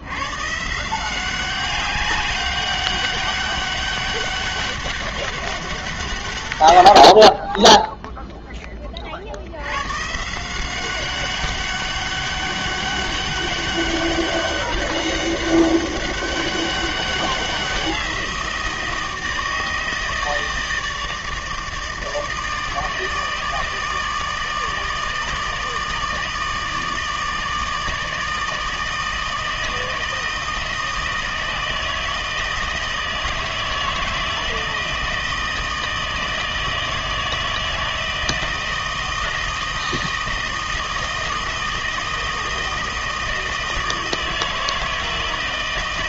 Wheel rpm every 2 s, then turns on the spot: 140, 200, 200, 120, 10, 170, 200, 200, 200, 170, 160, 160, 160, 160, 160, 160, 160, 160, 160, 160, 160, 160, 160.
none